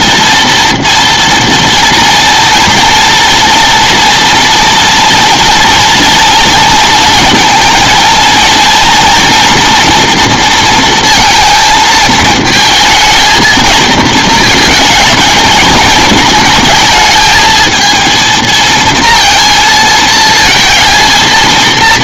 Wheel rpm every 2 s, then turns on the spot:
230, 230, 230, 220, 230, 230, 220, 230, 230, 230, 230.
none